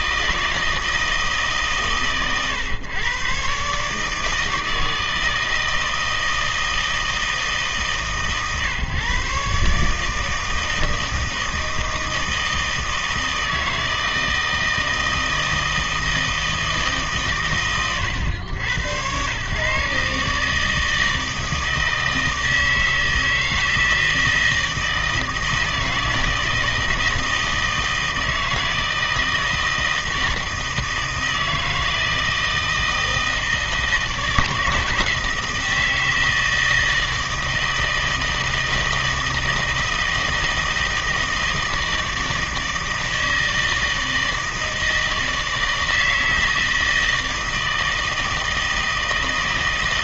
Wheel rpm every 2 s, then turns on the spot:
160, 120, 160, 160, 130, 160, 160, 160, 160, 90, 150, 160, 160, 160, 160, 160, 160, 160, 160, 160, 160, 160, 160, 160, 160.
none